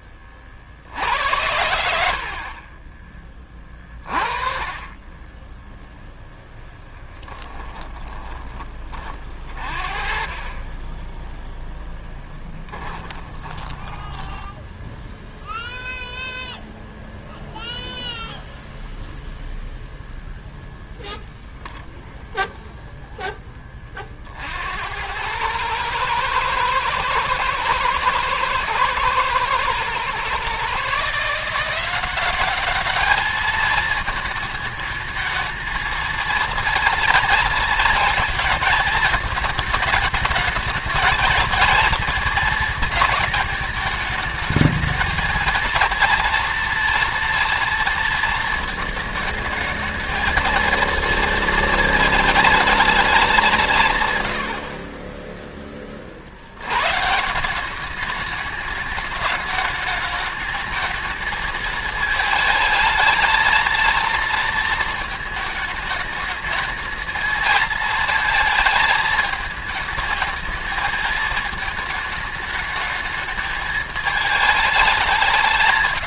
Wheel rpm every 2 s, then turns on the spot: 60, 30, 30, 10, 30, 20, 20, 10, 0, 0, 0, 0, 80, 110, 110, 130, 200, 220, 220, 220, 220, 220, 220, 230, 220, 230, 220, 50, 100, 210, 220, 220, 220, 220, 220, 220, 220, 200.
2-4 6-8 12-16 54-56